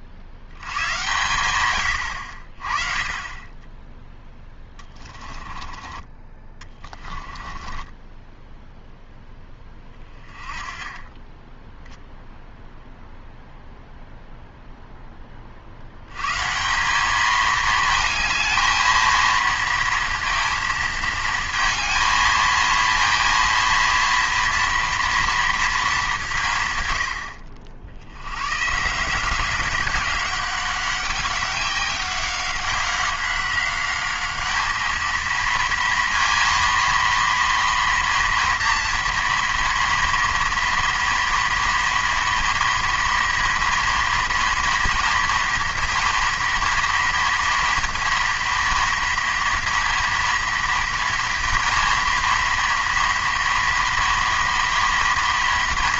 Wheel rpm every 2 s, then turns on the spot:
80, 50, 10, 20, 10, 20, 0, 0, 150, 220, 220, 220, 230, 160, 130, 190, 190, 210, 230, 230, 230, 230, 230, 230, 230, 230, 240, 230.
4-10